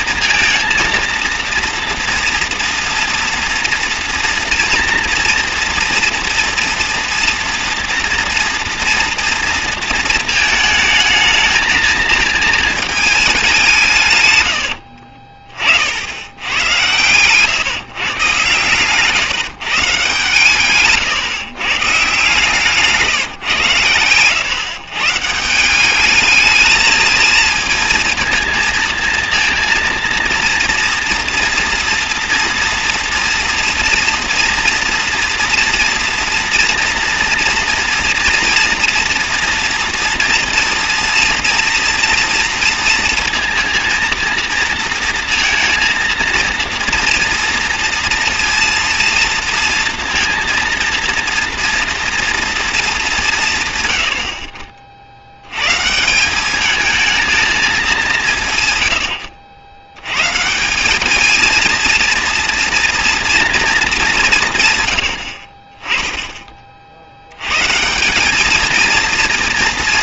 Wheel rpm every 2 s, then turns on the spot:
230, 230, 230, 230, 230, 220, 220, 100, 100, 140, 130, 150, 120, 220, 230, 230, 240, 230, 230, 240, 230, 240, 230, 230, 230, 230, 230, 50, 210, 140, 170, 230, 150, 30, 210.
14-18